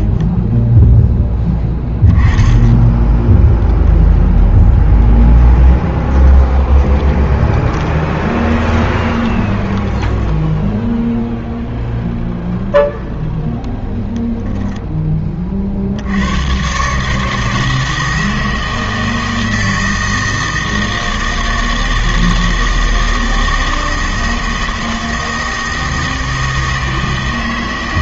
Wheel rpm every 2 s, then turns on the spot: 10, 10, 10, 20, 20, 0, 0, 10, 140, 160, 160, 160, 160, 160.
0-2 6-10